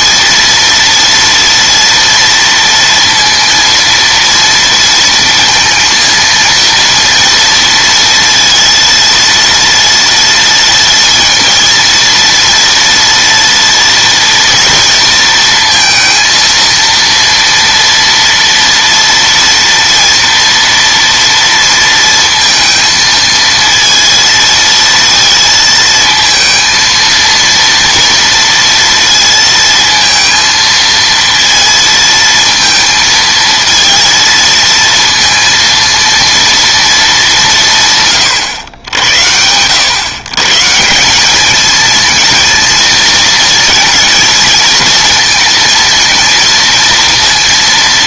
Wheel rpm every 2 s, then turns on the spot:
230, 230, 230, 230, 230, 240, 230, 230, 230, 230, 230, 220, 230, 230, 230, 230, 220, 230, 230, 100, 160, 230, 230, 230.
none